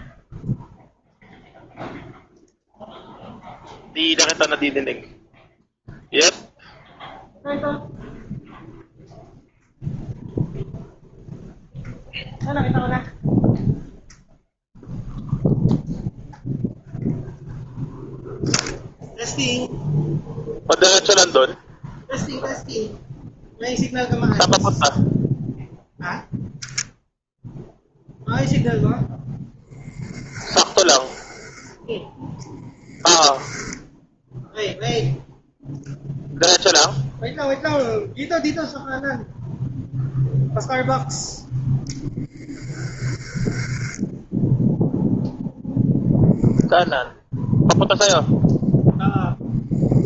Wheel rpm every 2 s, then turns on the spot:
0, 0, 0, 0, 0, 0, 0, 0, 0, 0, 0, 0, 0, 0, 10, 20, 10, 0, 0, 0, 0, 20, 0, 0, 0.
30-34 42-44